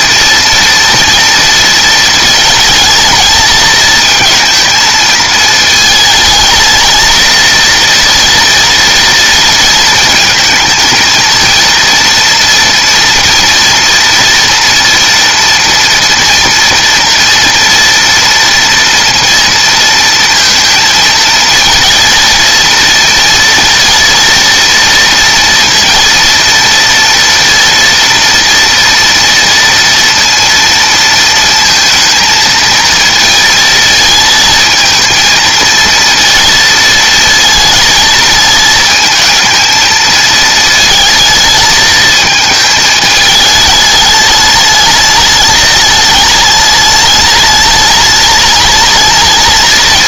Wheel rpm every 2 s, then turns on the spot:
230, 230, 230, 220, 230, 220, 230, 230, 230, 230, 230, 230, 230, 230, 230, 230, 230, 220, 230, 220, 220, 220, 210, 210, 210.
none